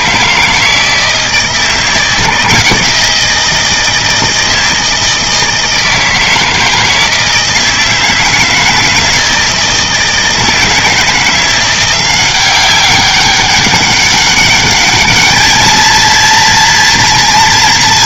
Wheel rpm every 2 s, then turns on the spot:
160, 170, 160, 160, 160, 160, 190, 200, 230.
none